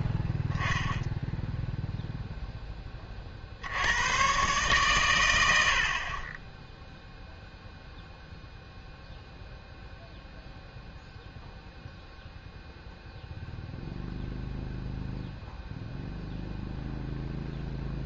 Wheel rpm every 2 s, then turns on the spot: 10, 10, 130, 10, 0, 0, 0, 0, 0.
none